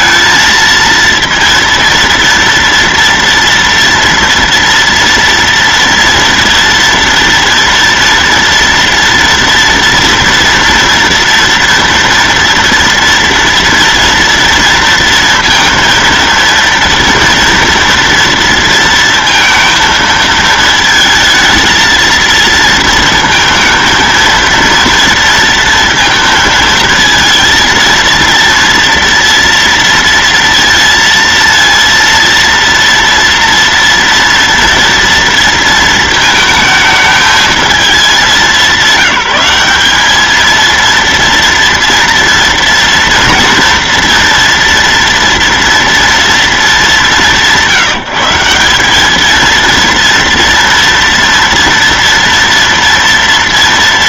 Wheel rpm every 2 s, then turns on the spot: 230, 230, 230, 230, 230, 230, 230, 230, 230, 230, 220, 230, 230, 230, 230, 230, 230, 230, 220, 200, 230, 230, 230, 230, 180, 230, 230.
none